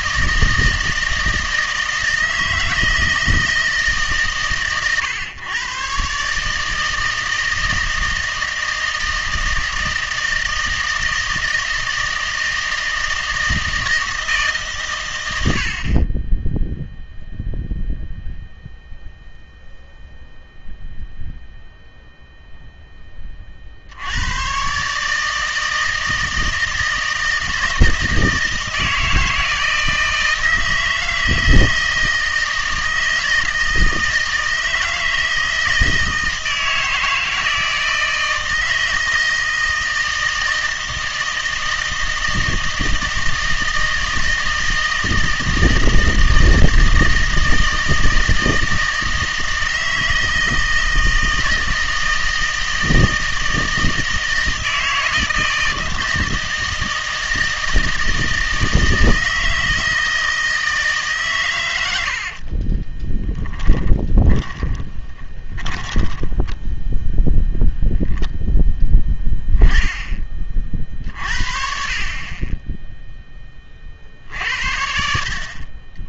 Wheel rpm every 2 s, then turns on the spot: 160, 160, 120, 160, 160, 160, 160, 130, 0, 0, 0, 10, 140, 160, 160, 160, 160, 160, 160, 160, 160, 160, 160, 160, 160, 160, 160, 160, 160, 160, 160, 30, 20, 10, 10, 40, 10, 60.
62-66